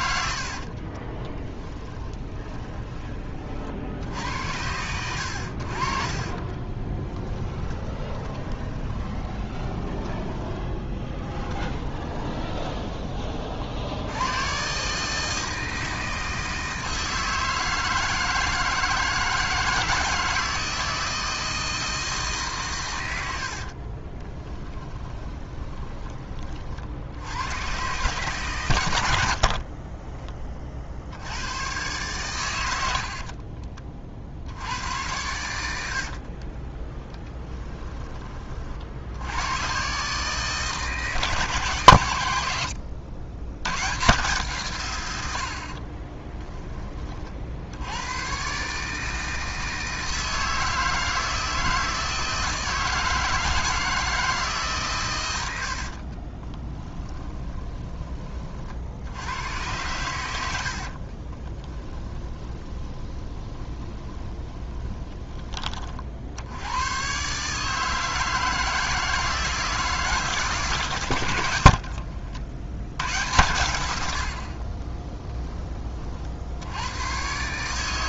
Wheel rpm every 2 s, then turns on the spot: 50, 20, 90, 20, 30, 10, 20, 140, 160, 160, 160, 130, 10, 50, 110, 50, 90, 80, 40, 40, 150, 80, 140, 10, 130, 160, 160, 140, 20, 60, 60, 20, 30, 100, 160, 130, 80, 40, 90.
0-2 6-12 24-26 36-38 56-58 60-66 74-76